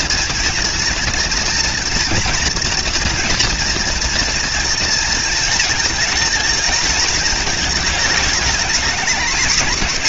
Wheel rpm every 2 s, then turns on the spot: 230, 240, 230, 230, 220.
none